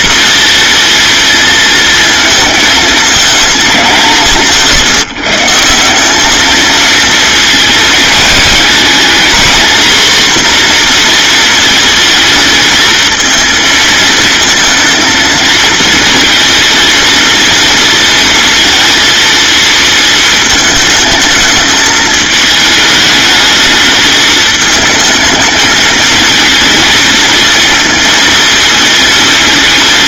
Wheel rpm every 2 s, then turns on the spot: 230, 210, 150, 220, 230, 230, 220, 220, 230, 230, 220, 220, 220, 230, 220.
none